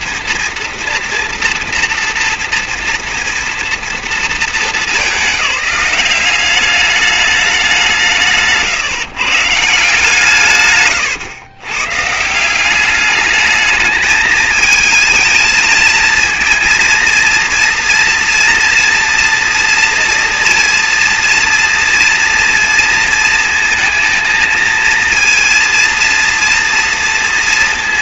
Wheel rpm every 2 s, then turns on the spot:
240, 230, 220, 200, 160, 150, 160, 220, 230, 230, 230, 230, 230, 230.
8-10